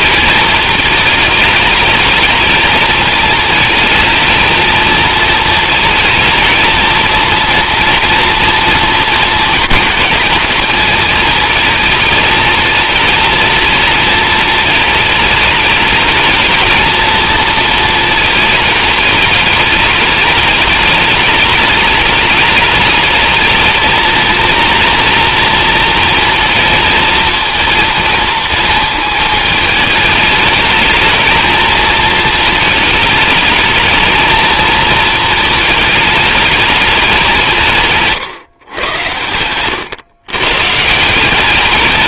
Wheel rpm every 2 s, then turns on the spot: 220, 220, 220, 230, 230, 230, 220, 220, 220, 220, 210, 220, 230, 230, 220, 220, 220, 220, 200, 120, 160.
38-40